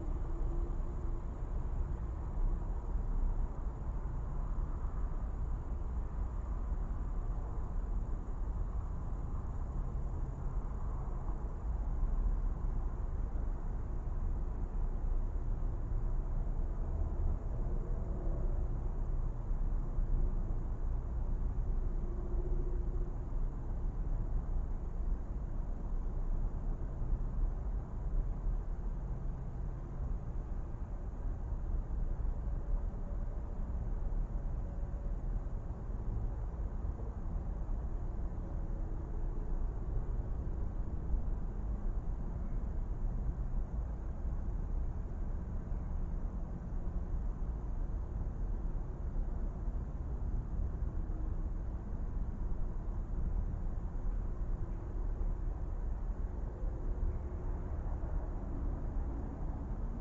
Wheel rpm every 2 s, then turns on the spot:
0, 0, 0, 0, 0, 0, 0, 0, 0, 0, 0, 0, 0, 0, 0, 0, 0, 0, 0, 0, 0, 0, 0, 0, 0, 0, 0, 0, 0, 0.
none